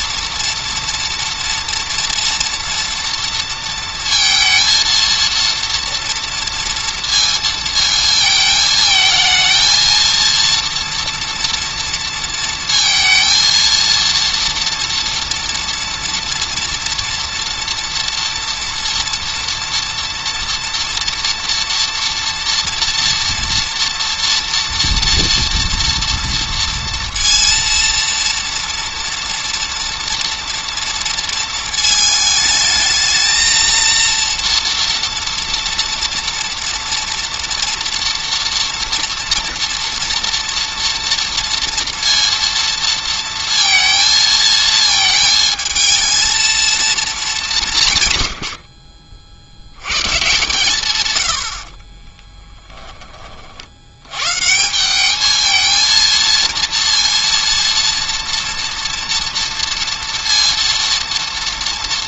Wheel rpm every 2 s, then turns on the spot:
230, 230, 230, 230, 220, 230, 230, 230, 230, 230, 230, 230, 230, 230, 230, 230, 220, 230, 230, 230, 230, 230, 220, 230, 70, 130, 10, 160, 230, 240, 230.
none